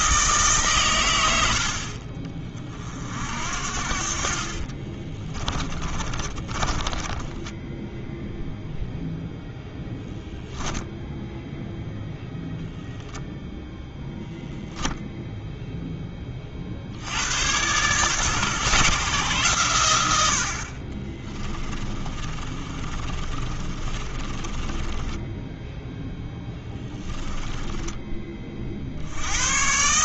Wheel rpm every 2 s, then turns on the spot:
140, 40, 30, 20, 0, 0, 0, 0, 60, 140, 40, 30, 30, 10, 50.
4-8 22-28